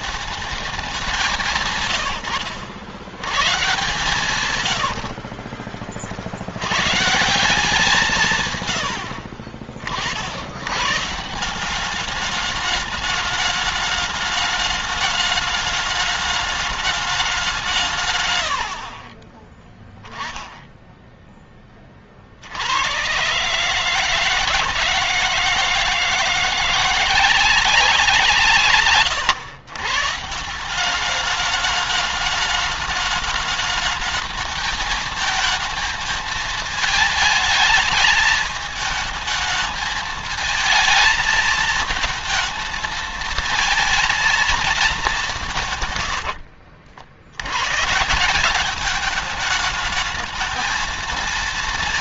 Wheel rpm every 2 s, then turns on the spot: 200, 110, 80, 120, 90, 130, 210, 210, 210, 50, 0, 110, 150, 170, 140, 190, 210, 220, 220, 220, 220, 230, 210, 70, 210, 220.
4-6